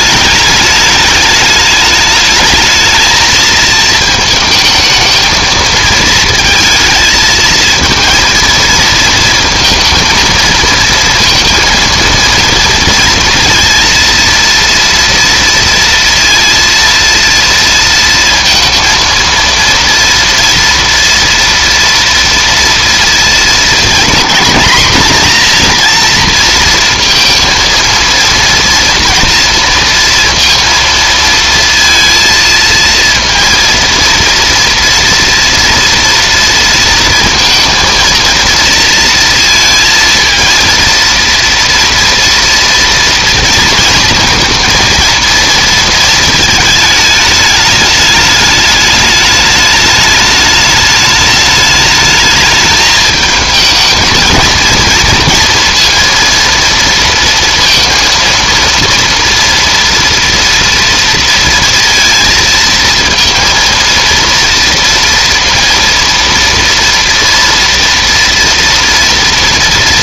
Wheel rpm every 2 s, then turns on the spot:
210, 220, 220, 220, 230, 230, 230, 230, 230, 230, 230, 230, 240, 230, 230, 230, 230, 230, 230, 230, 230, 230, 230, 220, 210, 210, 220, 230, 230, 230, 230, 230, 230, 230, 220.
none